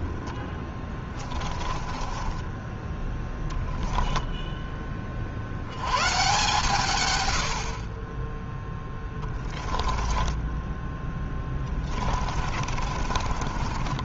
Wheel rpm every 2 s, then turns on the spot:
20, 20, 10, 130, 20, 20, 30.
0-4 8-14